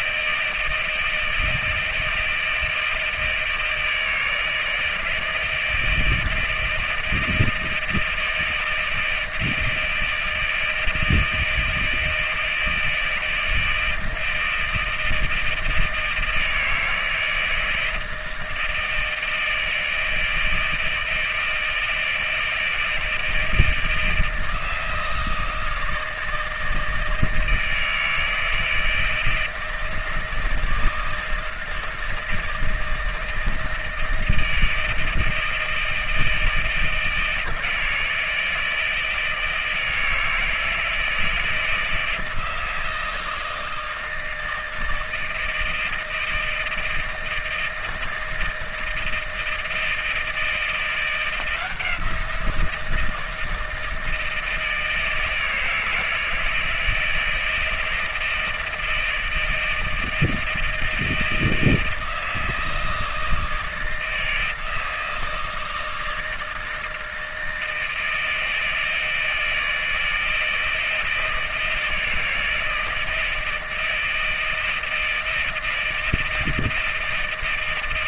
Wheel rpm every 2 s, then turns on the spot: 160, 160, 160, 160, 160, 160, 160, 160, 160, 160, 160, 160, 160, 160, 160, 160, 160, 160, 160, 160, 160, 170, 160, 160, 160, 170, 170, 160, 160, 160, 160, 160, 160, 160, 160, 160, 160, 160, 160.
none